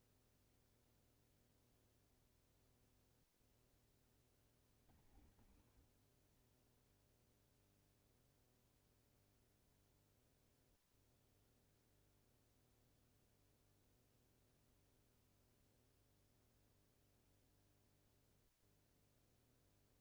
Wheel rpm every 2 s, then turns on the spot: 0, 0, 50, 30, 0, 0, 0, 0, 0, 0.
none